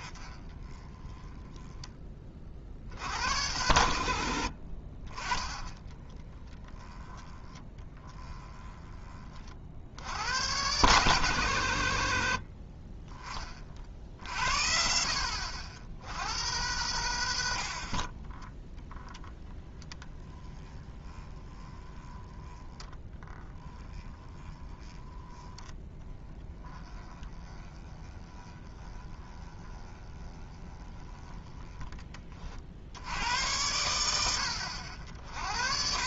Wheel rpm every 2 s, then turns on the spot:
20, 70, 50, 10, 20, 130, 50, 50, 100, 10, 20, 20, 20, 20, 20, 20, 70, 90.
0-2 6-8 14-16 18-32